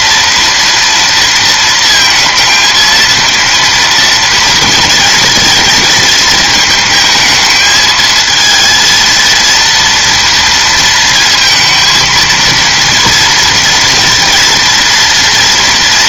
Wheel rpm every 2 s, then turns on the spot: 230, 230, 230, 220, 230, 230, 230, 230.
none